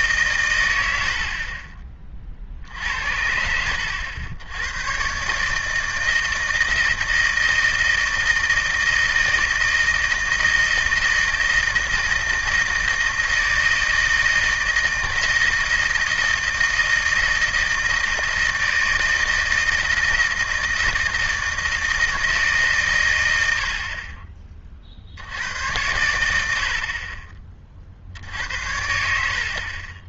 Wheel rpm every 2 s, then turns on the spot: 110, 60, 100, 170, 160, 160, 160, 160, 160, 160, 160, 150, 30, 70, 70.
none